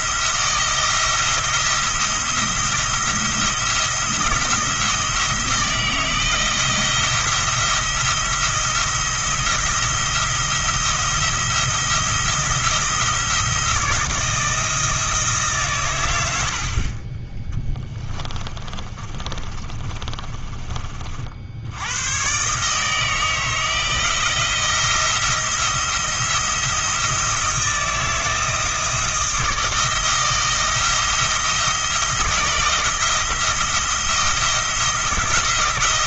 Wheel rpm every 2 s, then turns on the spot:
170, 170, 160, 170, 170, 170, 170, 160, 40, 40, 40, 150, 170, 170, 160, 160, 160, 170.
18-20